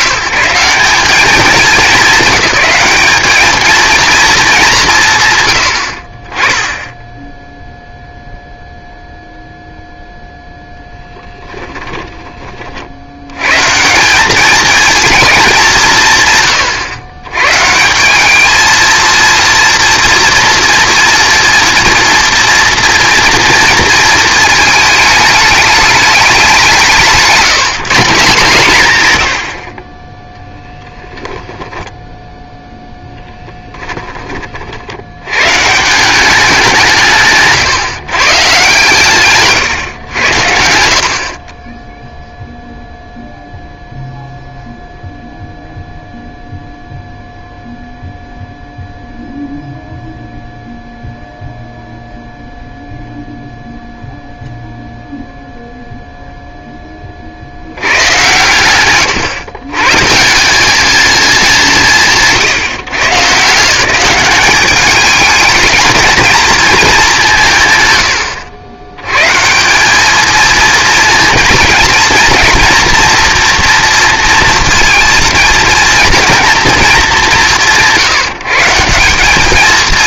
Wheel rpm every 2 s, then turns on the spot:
180, 200, 210, 20, 0, 0, 40, 210, 120, 220, 240, 230, 220, 180, 160, 0, 0, 40, 180, 130, 80, 0, 0, 0, 0, 0, 0, 0, 10, 110, 200, 170, 200, 220, 80, 220, 230, 230, 220, 180.
none